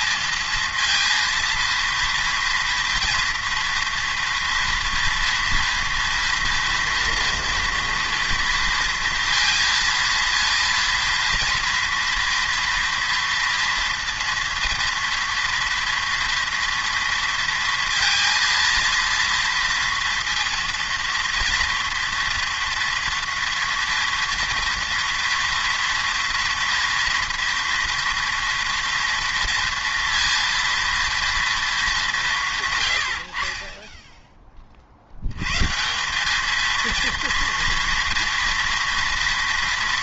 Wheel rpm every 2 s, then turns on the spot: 230, 240, 230, 230, 230, 230, 230, 230, 230, 230, 230, 230, 230, 230, 230, 230, 140, 30, 220, 230.
none